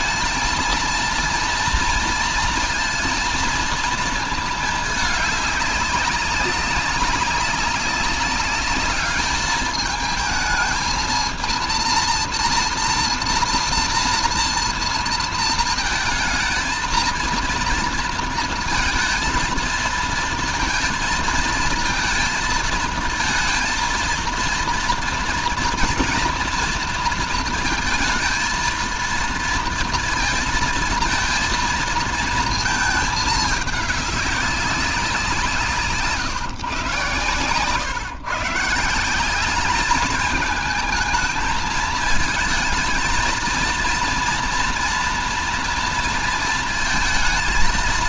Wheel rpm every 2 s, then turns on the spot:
230, 230, 210, 200, 210, 220, 230, 230, 230, 230, 230, 220, 230, 230, 230, 230, 220, 190, 120, 170, 220, 220, 240, 230.
none